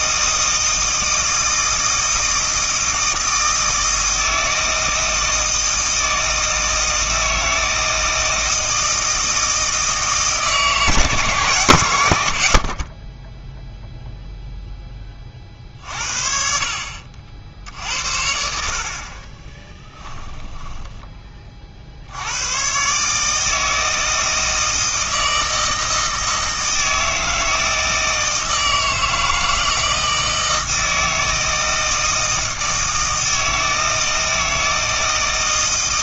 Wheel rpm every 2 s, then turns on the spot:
160, 160, 160, 160, 160, 160, 60, 10, 60, 70, 10, 120, 160, 160, 160, 160, 160, 160.
20-22